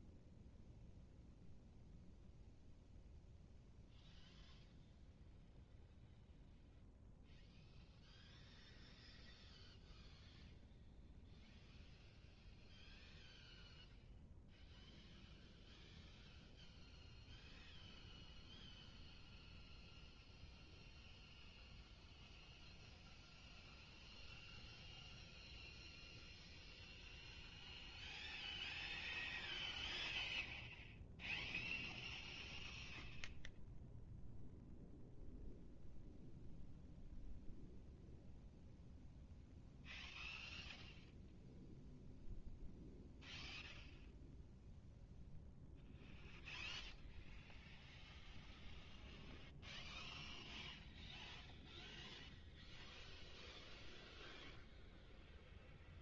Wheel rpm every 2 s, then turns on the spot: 0, 0, 0, 0, 0, 0, 0, 0, 0, 0, 0, 0, 0, 0, 0, 0, 0, 0, 0, 0, 0, 0, 0, 0, 0, 0, 0, 0.
none